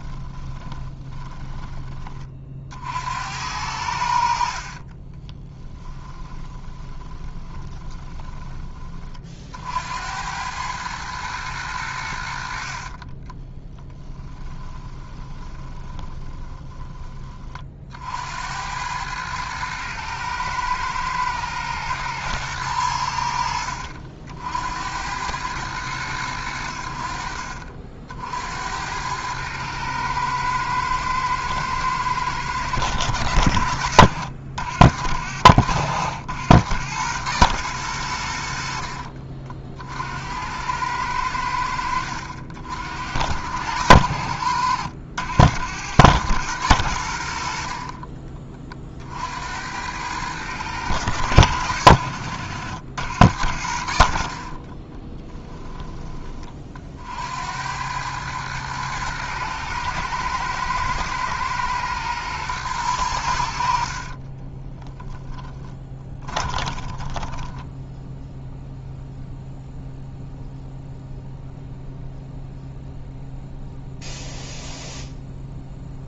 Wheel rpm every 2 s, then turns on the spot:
30, 60, 30, 20, 20, 100, 50, 20, 20, 90, 110, 100, 80, 70, 90, 110, 100, 60, 110, 60, 80, 70, 80, 100, 40, 110, 90, 30, 50, 110, 110, 110, 10, 20, 0, 0, 0, 0.
0-2 4-8 12-16 38-40 54-56 64-68